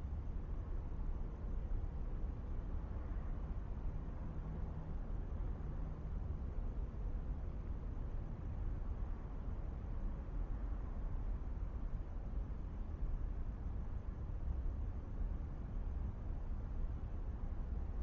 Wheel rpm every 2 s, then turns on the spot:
0, 0, 0, 0, 0, 0, 0, 0, 0.
none